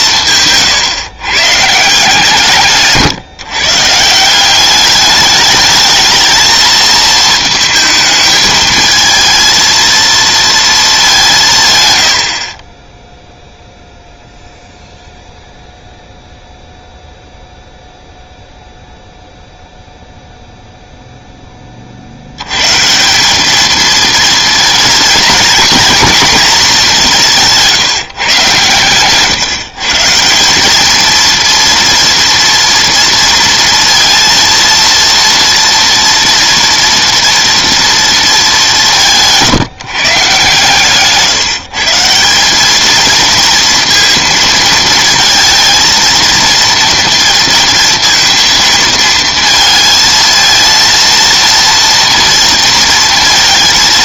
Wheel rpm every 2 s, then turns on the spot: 140, 150, 190, 220, 220, 220, 20, 0, 0, 0, 0, 140, 230, 220, 130, 200, 230, 230, 230, 190, 140, 210, 230, 230, 220, 230, 230.
none